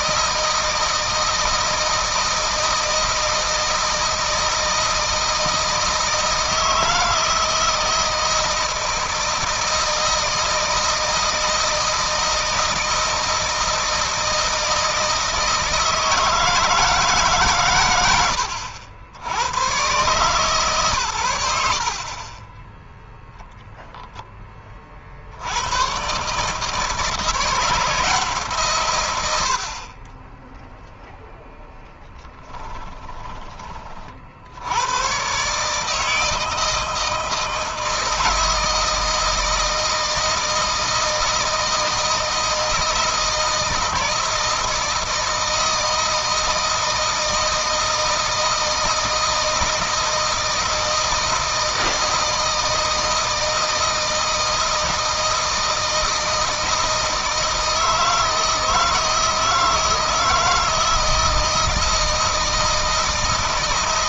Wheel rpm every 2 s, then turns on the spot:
160, 160, 160, 160, 160, 160, 160, 160, 160, 90, 120, 10, 40, 160, 130, 10, 20, 100, 160, 160, 160, 160, 160, 160, 160, 160, 160, 160, 160, 160, 160, 160.
32-34